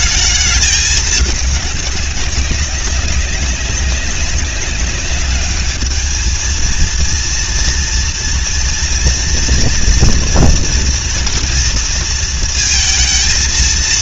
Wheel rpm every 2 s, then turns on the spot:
210, 190, 200, 220, 230, 240, 230.
none